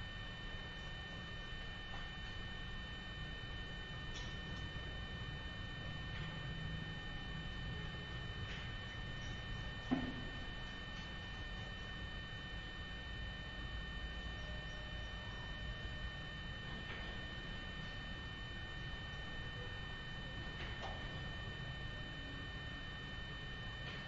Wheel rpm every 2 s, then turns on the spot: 0, 0, 0, 0, 0, 0, 0, 0, 0, 0, 0, 0.
none